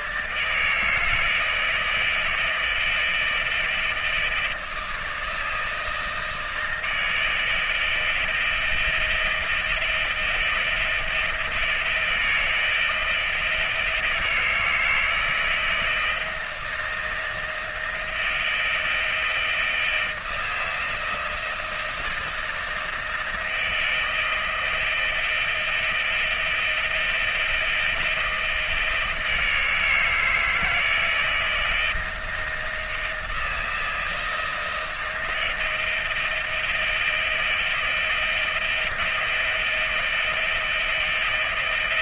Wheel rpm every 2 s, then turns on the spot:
140, 160, 160, 160, 160, 160, 160, 160, 160, 170, 170, 160, 170, 160, 170, 160, 160, 160, 160, 160, 170.
none